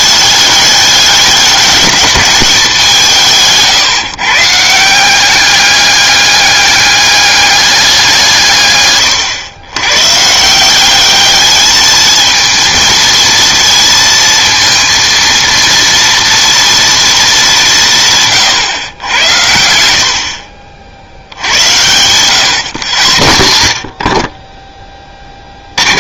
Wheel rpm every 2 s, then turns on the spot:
210, 190, 160, 200, 130, 170, 220, 230, 230, 120, 60, 120, 20.
none